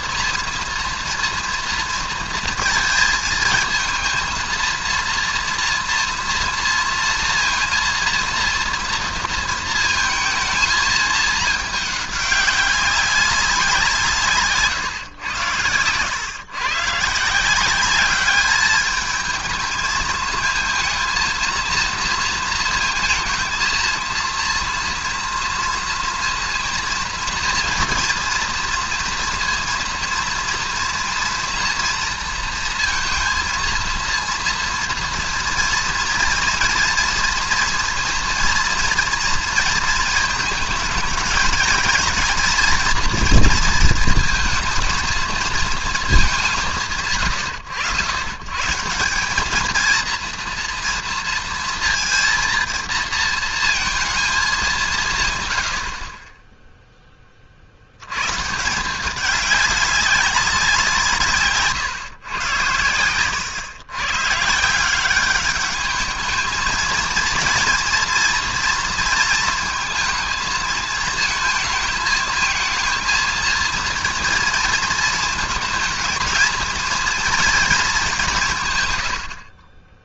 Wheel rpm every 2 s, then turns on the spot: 230, 230, 230, 230, 230, 220, 200, 120, 140, 210, 220, 230, 230, 230, 230, 230, 230, 230, 230, 230, 220, 230, 230, 110, 160, 230, 230, 160, 0, 170, 180, 100, 170, 220, 230, 220, 230, 230, 230, 120.
none